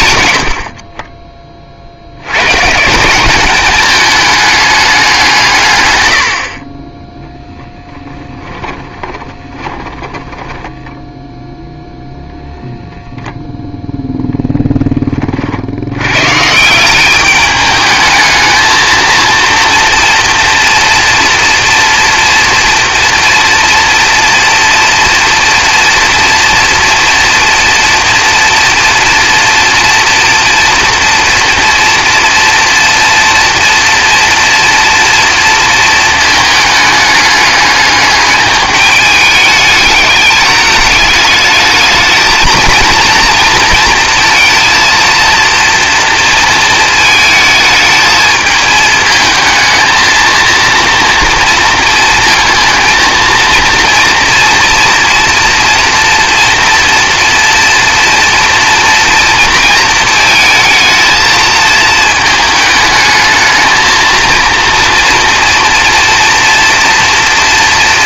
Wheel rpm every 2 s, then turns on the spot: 60, 130, 210, 40, 20, 10, 0, 0, 150, 220, 230, 240, 230, 230, 230, 240, 230, 230, 220, 210, 210, 220, 230, 220, 220, 230, 230, 230, 230, 230, 220, 220, 230, 240.
8-12